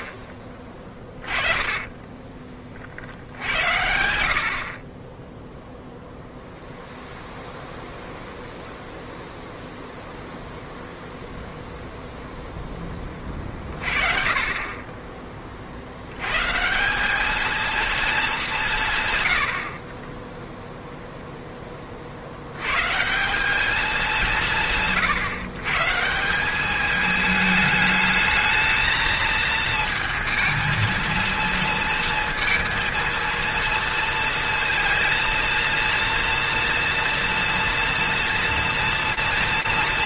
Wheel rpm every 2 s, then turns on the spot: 20, 50, 20, 0, 0, 0, 10, 20, 150, 170, 0, 100, 150, 200, 220, 220, 230, 230, 230, 240.
0-2